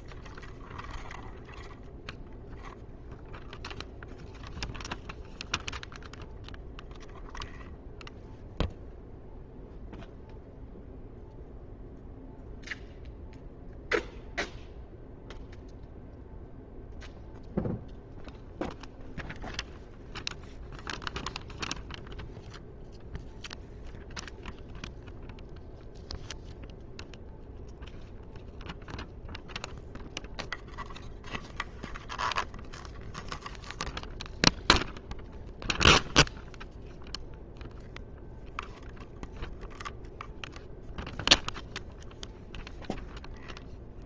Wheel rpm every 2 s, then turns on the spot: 0, 0, 0, 0, 0, 0, 0, 0, 0, 0, 0, 0, 0, 0, 0, 0, 0, 0, 0, 0, 0, 0.
none